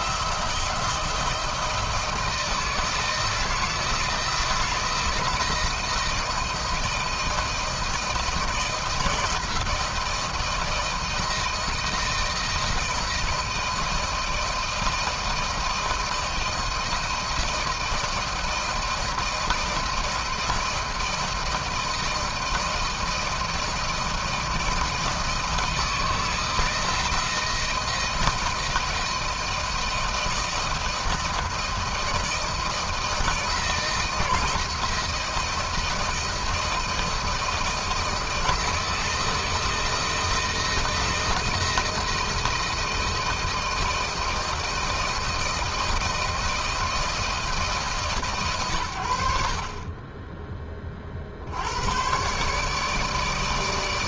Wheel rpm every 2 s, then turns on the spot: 160, 160, 170, 170, 160, 170, 170, 170, 160, 170, 160, 170, 160, 160, 160, 170, 160, 160, 170, 170, 160, 170, 160, 160, 80, 40, 150.
none